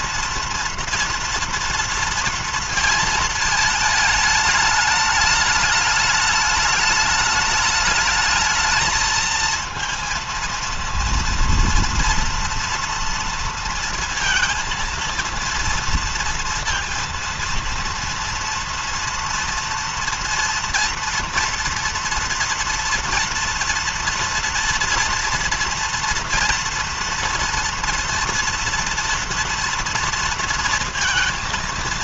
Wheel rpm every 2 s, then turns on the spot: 230, 230, 210, 210, 220, 230, 230, 230, 230, 230, 230, 230, 230, 230, 230, 230.
none